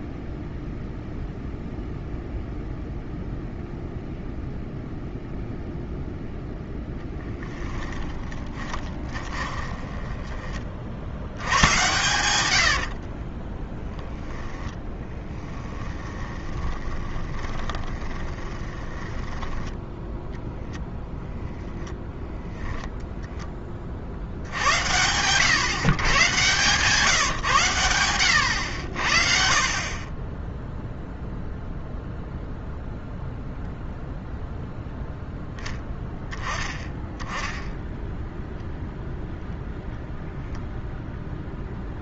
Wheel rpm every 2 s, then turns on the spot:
0, 0, 0, 0, 20, 20, 10, 10, 20, 20, 0, 0, 80, 140, 90, 0, 0, 0, 10, 0, 0.
8-10 12-20